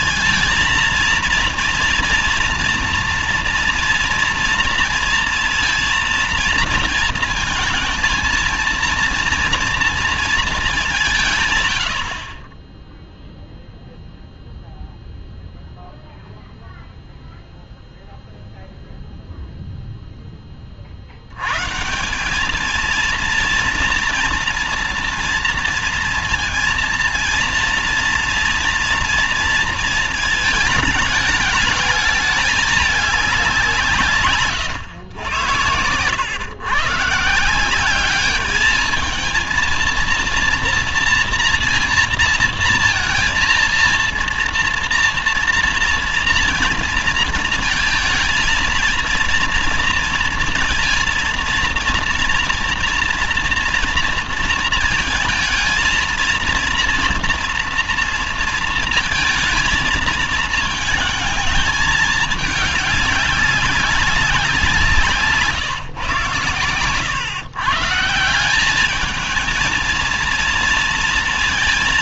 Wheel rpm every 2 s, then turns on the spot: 230, 240, 230, 230, 230, 200, 10, 0, 0, 0, 30, 210, 230, 230, 230, 220, 210, 120, 130, 210, 240, 230, 230, 230, 230, 230, 230, 230, 230, 230, 220, 210, 170, 130, 180, 230.
66-68